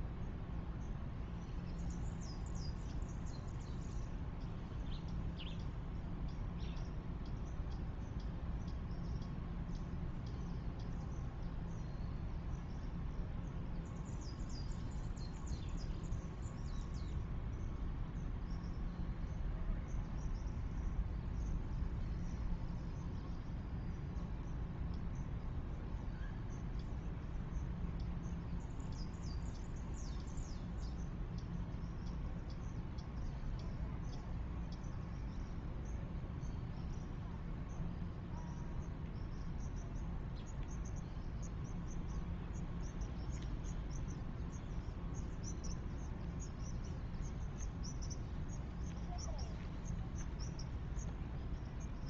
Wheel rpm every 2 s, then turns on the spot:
0, 0, 0, 0, 0, 0, 0, 0, 0, 0, 0, 0, 0, 0, 0, 0, 0, 0, 0, 0, 0, 0, 0, 0, 0, 0.
none